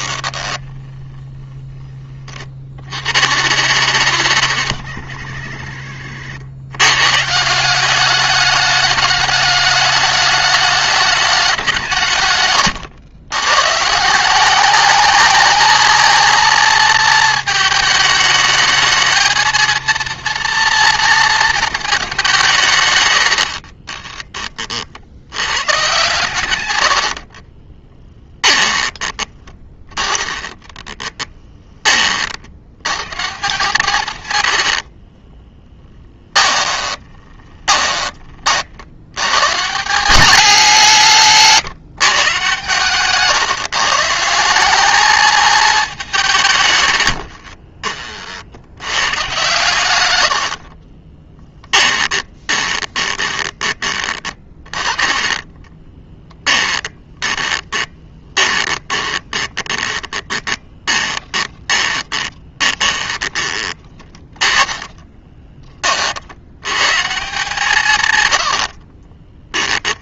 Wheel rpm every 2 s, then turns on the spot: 20, 40, 100, 100, 200, 210, 110, 200, 230, 220, 230, 150, 40, 110, 10, 20, 80, 80, 20, 60, 180, 140, 190, 120, 80, 50, 20, 20, 20, 20, 20, 20, 20, 100, 70.
0-2 12-14 26-32 34-38 50-54 56-66 68-70